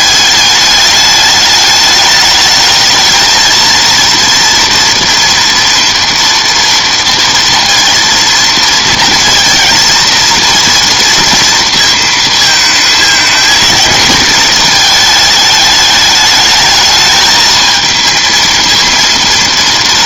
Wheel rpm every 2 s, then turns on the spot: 210, 220, 230, 230, 230, 230, 220, 220, 220, 230.
none